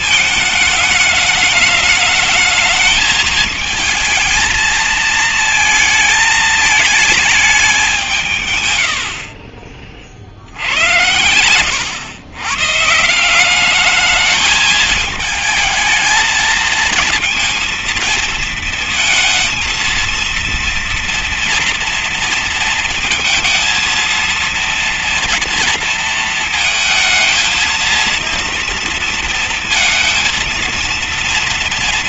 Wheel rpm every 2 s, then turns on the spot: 220, 210, 220, 220, 140, 70, 130, 220, 220, 230, 230, 220, 230, 230, 230, 230.
10-12